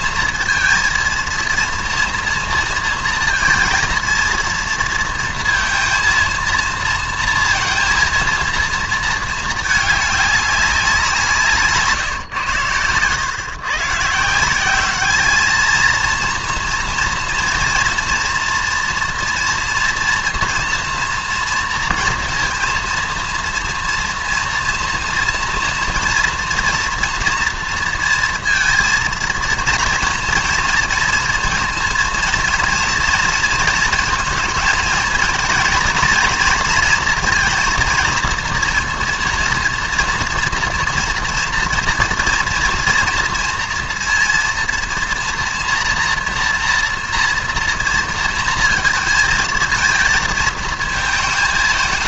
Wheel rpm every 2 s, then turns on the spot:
230, 230, 230, 230, 230, 190, 110, 190, 230, 230, 230, 230, 230, 230, 230, 230, 230, 220, 230, 230, 230, 230, 230, 230, 230, 230.
none